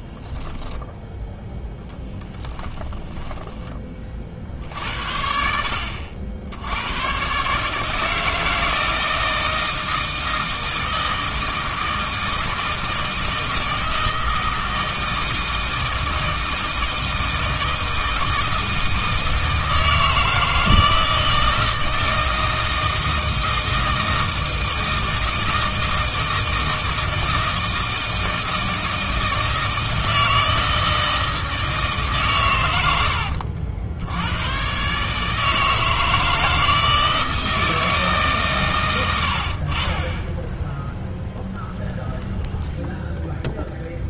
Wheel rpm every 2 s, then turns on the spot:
0, 10, 60, 90, 160, 160, 160, 160, 160, 160, 160, 160, 160, 160, 160, 160, 90, 120, 160, 110, 0, 0.
2-4